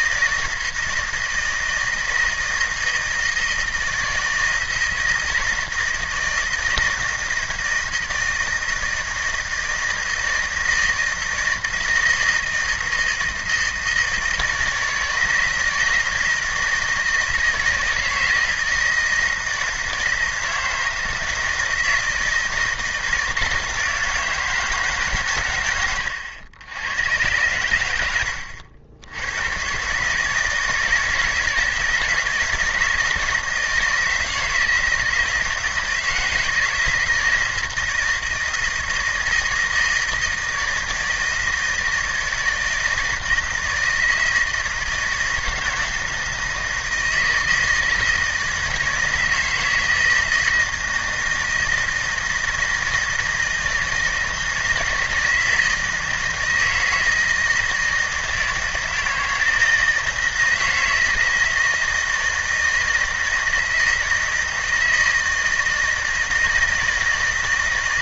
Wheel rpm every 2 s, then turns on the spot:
160, 160, 160, 160, 160, 160, 170, 160, 160, 160, 160, 160, 160, 100, 80, 160, 160, 160, 160, 160, 160, 160, 160, 160, 160, 160, 160, 160, 160, 160, 160, 160, 160, 170.
none